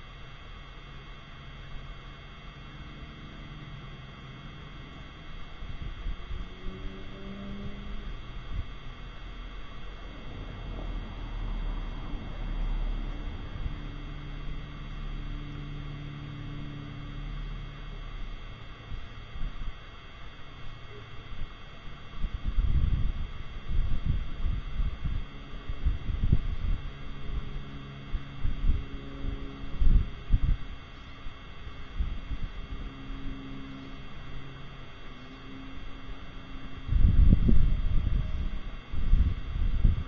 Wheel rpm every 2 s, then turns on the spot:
0, 0, 0, 0, 0, 0, 0, 0, 0, 0, 0, 0, 0, 0, 0, 0, 0, 0, 0, 0.
none